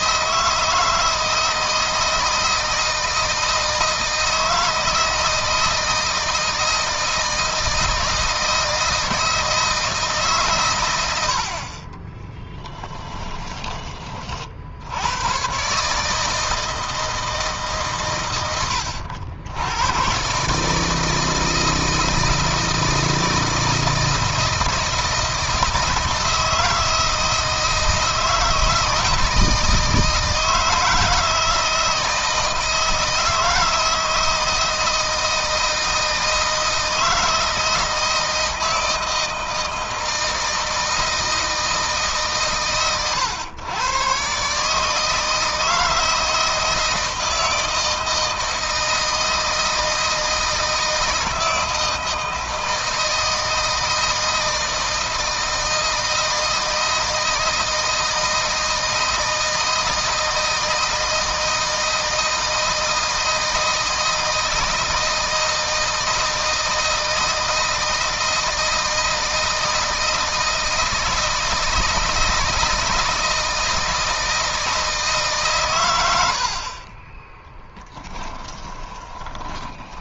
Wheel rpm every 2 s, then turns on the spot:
160, 160, 160, 160, 160, 110, 20, 80, 160, 110, 150, 160, 160, 160, 160, 160, 160, 160, 160, 160, 160, 130, 140, 160, 160, 160, 160, 160, 160, 160, 160, 160, 160, 160, 160, 160, 160, 160, 40, 10.
12-14 76-80